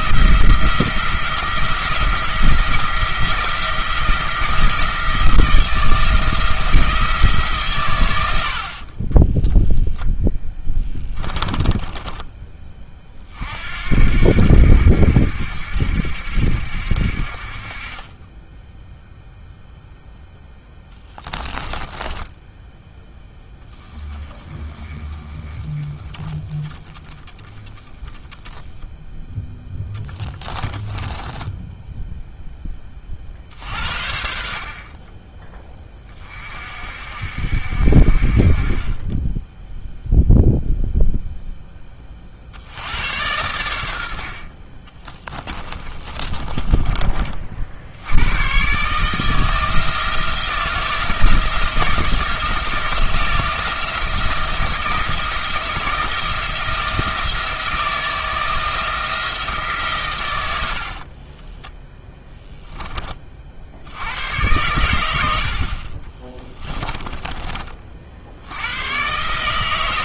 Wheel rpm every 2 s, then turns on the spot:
170, 170, 170, 160, 40, 10, 30, 80, 60, 0, 10, 10, 20, 10, 0, 10, 20, 40, 50, 30, 0, 90, 30, 20, 140, 160, 170, 170, 160, 160, 70, 10, 100, 20, 100.
10-12 20-22 30-32 46-48 60-62 66-68